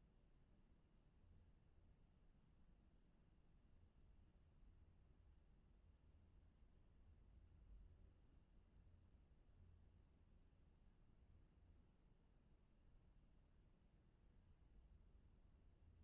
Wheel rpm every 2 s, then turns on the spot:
0, 0, 0, 0, 0, 0, 0, 0.
none